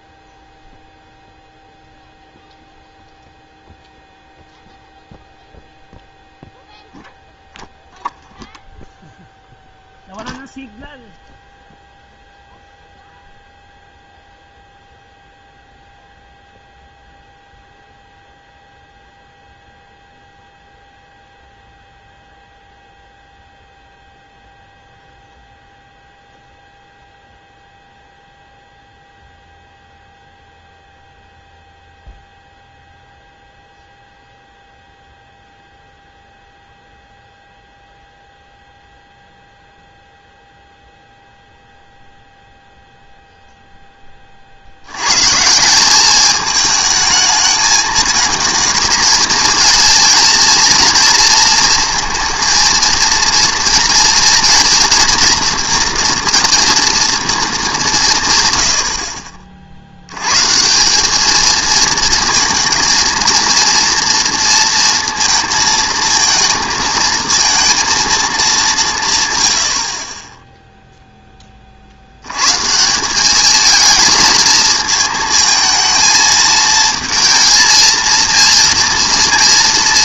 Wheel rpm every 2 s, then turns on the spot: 0, 0, 0, 0, 0, 0, 0, 0, 0, 0, 0, 0, 0, 0, 0, 0, 0, 0, 0, 0, 0, 0, 50, 220, 220, 230, 230, 230, 240, 110, 140, 230, 230, 230, 200, 10, 120, 220, 220, 230.
70-72